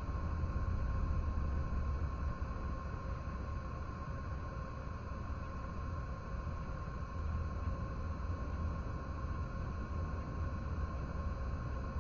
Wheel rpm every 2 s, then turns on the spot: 0, 0, 0, 0, 0, 0.
none